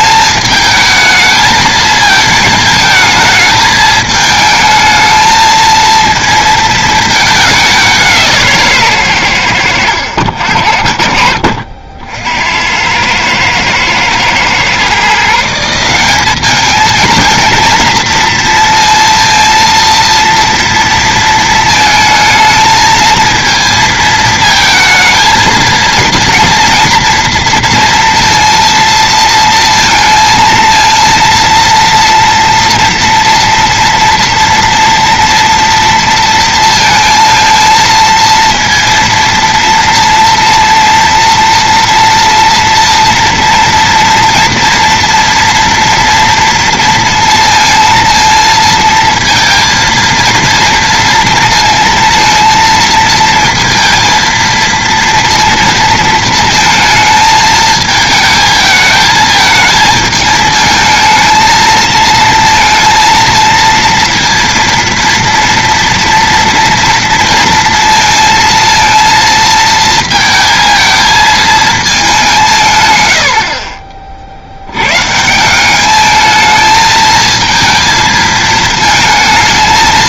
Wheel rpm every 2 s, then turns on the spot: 220, 220, 220, 220, 140, 60, 90, 130, 220, 230, 230, 220, 230, 230, 230, 230, 230, 230, 230, 230, 230, 230, 230, 230, 230, 230, 230, 230, 230, 220, 220, 230, 230, 230, 230, 220, 150, 100, 220, 220.
none